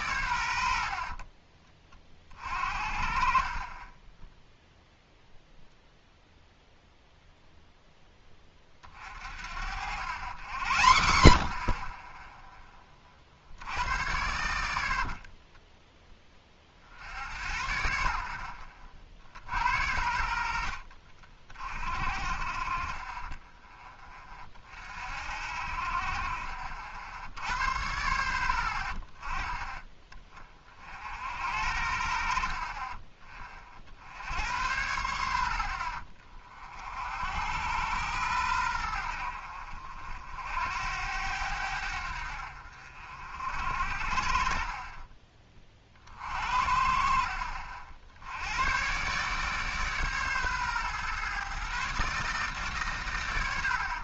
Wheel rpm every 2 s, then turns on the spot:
80, 40, 0, 0, 30, 100, 20, 70, 40, 60, 60, 30, 40, 70, 50, 40, 50, 80, 50, 90, 80, 60, 40, 50, 110, 130, 130.
14-16